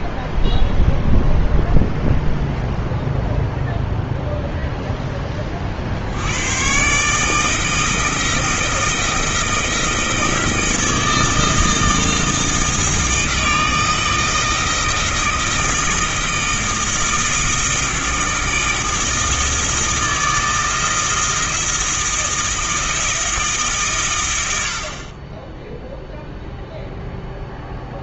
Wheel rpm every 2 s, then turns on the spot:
0, 0, 0, 140, 170, 160, 160, 160, 160, 160, 160, 160, 80, 0.
none